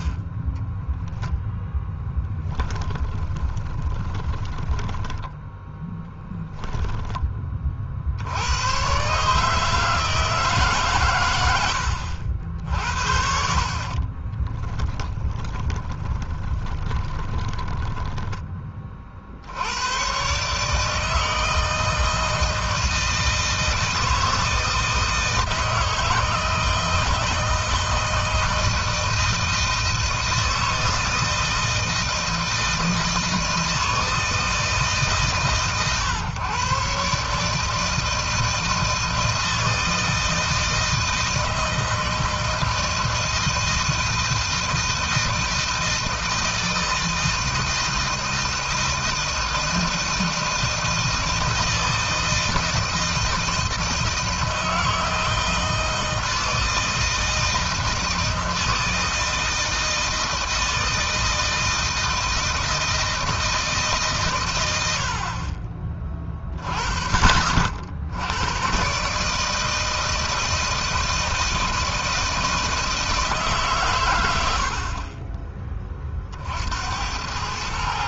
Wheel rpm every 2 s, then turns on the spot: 10, 10, 10, 10, 110, 130, 60, 20, 20, 30, 150, 160, 160, 160, 160, 160, 160, 150, 130, 160, 160, 160, 160, 160, 160, 160, 160, 160, 160, 160, 160, 160, 100, 40, 120, 160, 160, 60, 80.
0-6 14-18